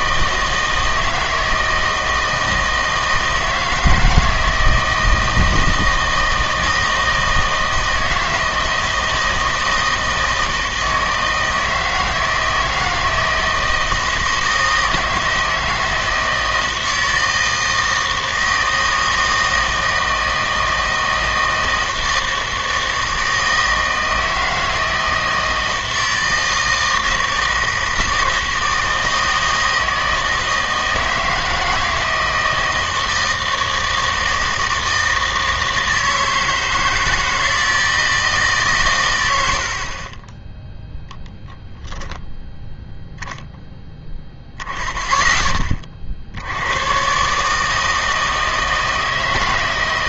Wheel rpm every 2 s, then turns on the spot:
160, 160, 160, 160, 160, 160, 160, 160, 160, 160, 160, 160, 160, 160, 160, 160, 160, 160, 160, 130, 10, 10, 0, 90, 160.
none